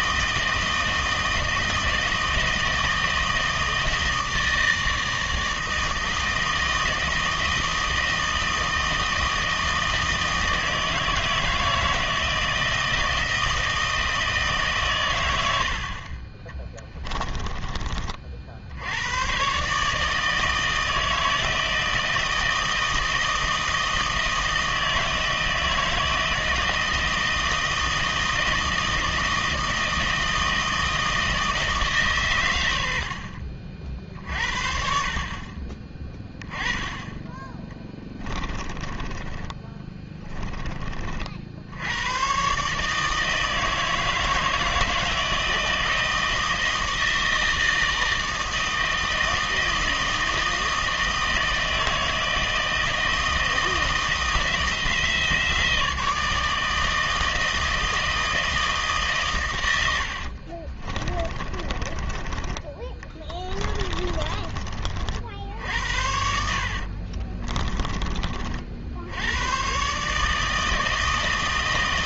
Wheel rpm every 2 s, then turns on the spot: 160, 160, 160, 160, 160, 160, 160, 150, 20, 50, 160, 160, 160, 160, 160, 160, 110, 50, 10, 20, 20, 130, 160, 160, 160, 160, 160, 170, 160, 160, 50, 20, 30, 70, 50, 160.
16-18 38-40 60-62 66-68